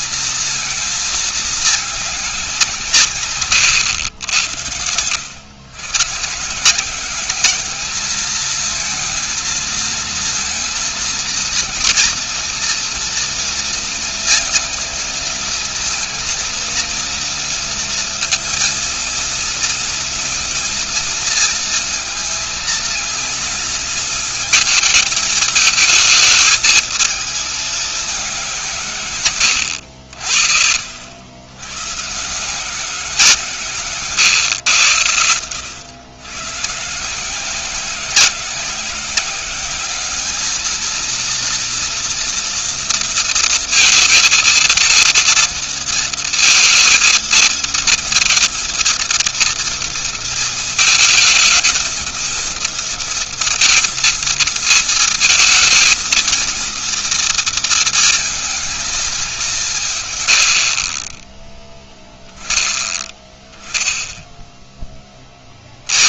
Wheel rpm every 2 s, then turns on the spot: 220, 180, 90, 150, 220, 230, 230, 230, 220, 230, 230, 230, 220, 220, 190, 60, 140, 130, 110, 180, 210, 230, 230, 230, 230, 230, 220, 230, 230, 230, 100, 0, 0.
none